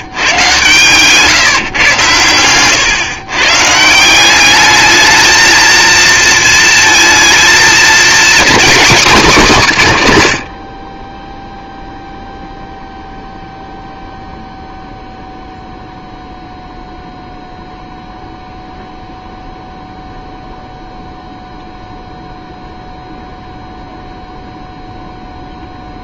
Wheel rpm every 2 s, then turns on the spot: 130, 120, 210, 230, 240, 50, 0, 0, 0, 0, 0, 0, 0.
2-4